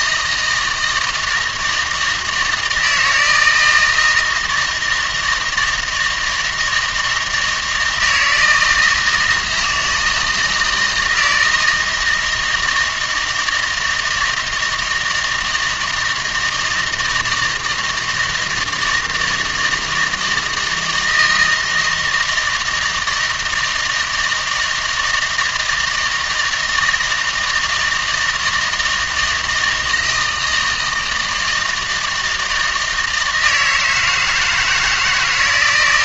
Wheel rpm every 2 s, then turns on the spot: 160, 160, 160, 160, 160, 160, 160, 160, 160, 160, 160, 160, 160, 160, 170, 160, 160, 160.
none